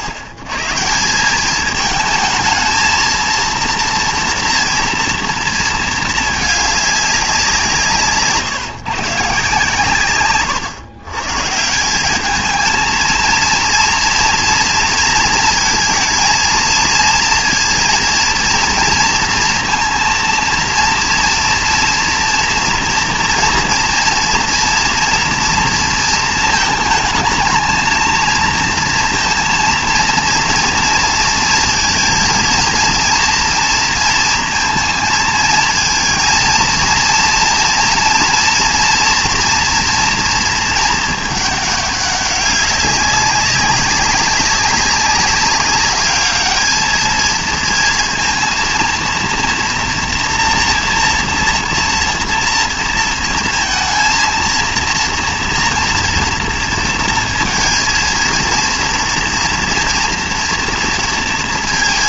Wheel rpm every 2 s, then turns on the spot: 130, 220, 230, 210, 140, 100, 220, 230, 230, 230, 230, 230, 230, 220, 230, 230, 230, 230, 230, 230, 230, 200, 190, 220, 230, 230, 230, 230, 230, 230, 230.
none